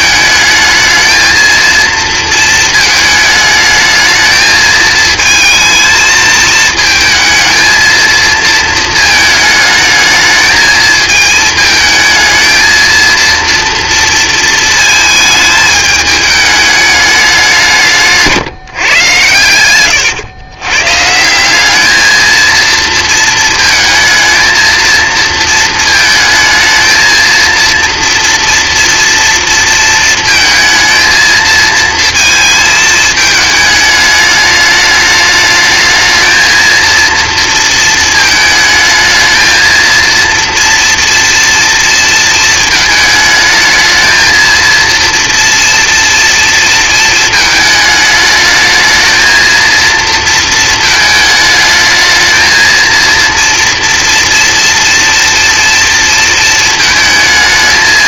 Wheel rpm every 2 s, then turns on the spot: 220, 220, 220, 220, 220, 220, 220, 230, 210, 150, 120, 220, 220, 220, 230, 230, 230, 210, 220, 220, 230, 220, 230, 230, 210, 220, 230, 230, 230.
none